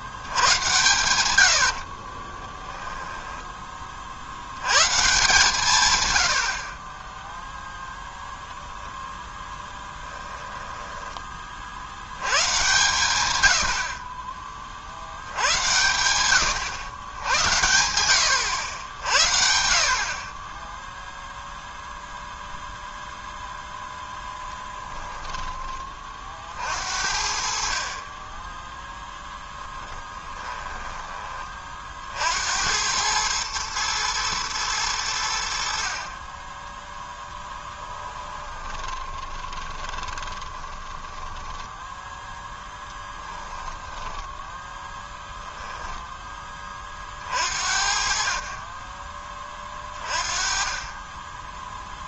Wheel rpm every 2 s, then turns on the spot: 100, 10, 120, 40, 0, 10, 120, 50, 110, 80, 10, 0, 10, 60, 10, 10, 90, 110, 10, 20, 20, 10, 10, 30, 20, 20.
2-4 10-12 24-26 30-32 38-44